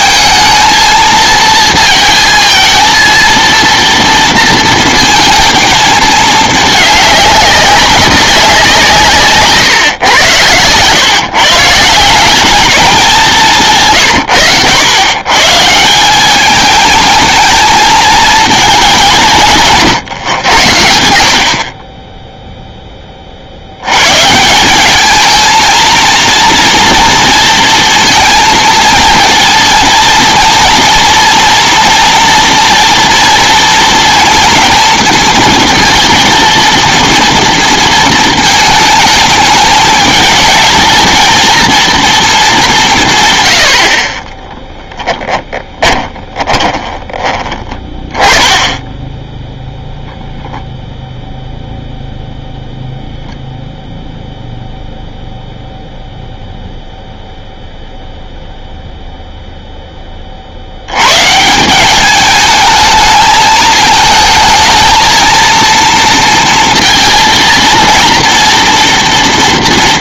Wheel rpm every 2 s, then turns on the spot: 220, 230, 230, 210, 170, 120, 200, 100, 220, 210, 100, 10, 190, 230, 230, 230, 230, 230, 230, 220, 220, 170, 10, 10, 10, 0, 0, 0, 0, 0, 90, 220, 220, 230, 230.
44-48